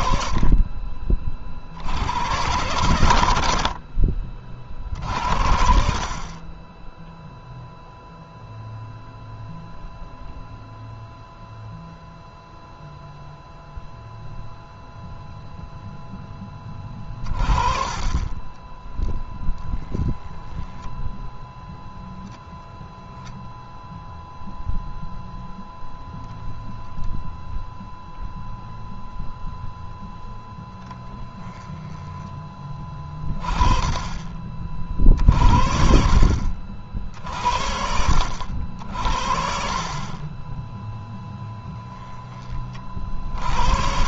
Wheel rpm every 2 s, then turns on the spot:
50, 110, 50, 10, 0, 0, 0, 0, 30, 20, 10, 10, 0, 10, 0, 10, 30, 50, 50, 70, 10, 40.
18-20 22-24 30-32